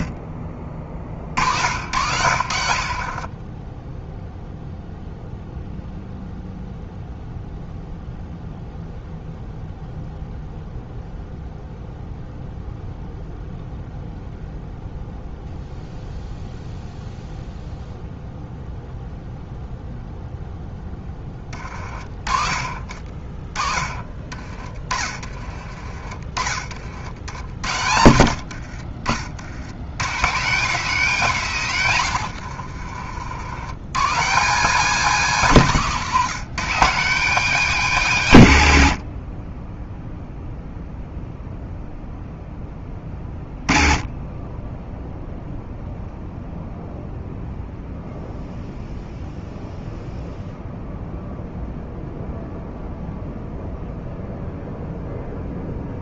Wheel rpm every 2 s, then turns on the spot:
50, 60, 0, 0, 0, 0, 0, 0, 0, 0, 10, 30, 30, 50, 60, 190, 70, 200, 190, 90, 0, 20, 0, 0, 0, 0, 0, 0.
2-4 28-30 32-34